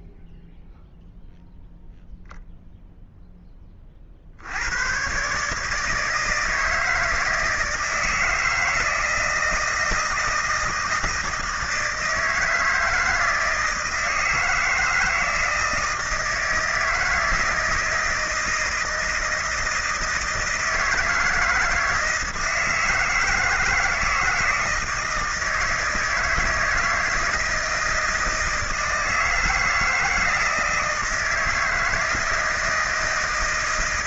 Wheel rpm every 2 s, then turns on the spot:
0, 0, 100, 160, 160, 160, 160, 160, 160, 160, 160, 160, 160, 160, 160, 160, 160.
none